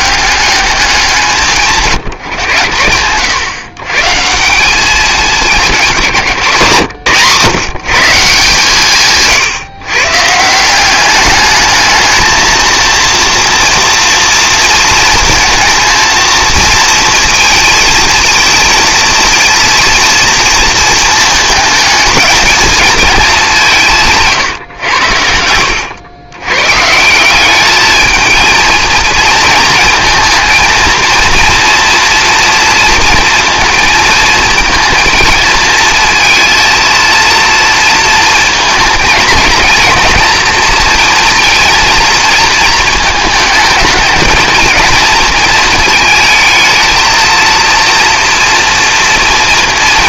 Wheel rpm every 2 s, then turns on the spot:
200, 100, 180, 160, 150, 160, 230, 230, 230, 230, 230, 220, 140, 130, 230, 230, 230, 230, 230, 220, 230, 230, 220, 220, 230.
none